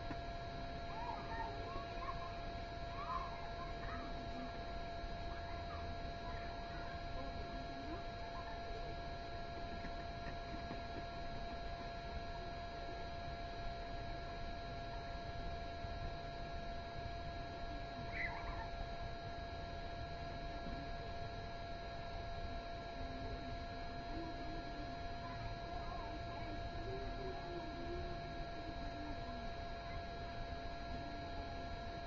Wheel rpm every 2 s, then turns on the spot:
0, 0, 0, 0, 0, 0, 0, 0, 0, 0, 0, 0, 0, 0, 0, 0.
none